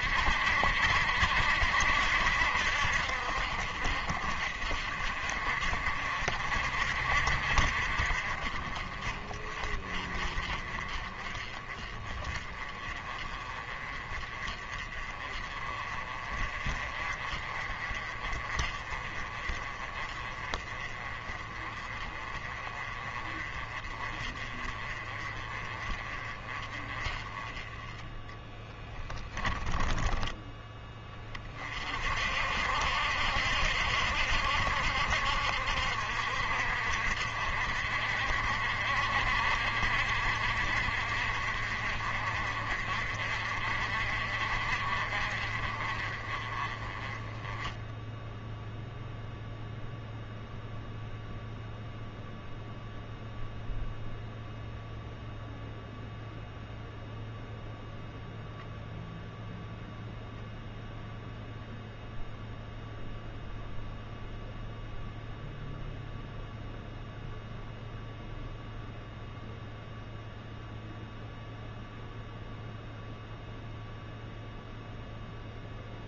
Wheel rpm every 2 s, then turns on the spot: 60, 60, 50, 60, 40, 30, 30, 30, 40, 30, 30, 30, 30, 30, 10, 20, 70, 70, 60, 50, 50, 50, 40, 20, 0, 0, 0, 0, 0, 0, 0, 0, 0, 0, 0, 0, 0, 0.
28-30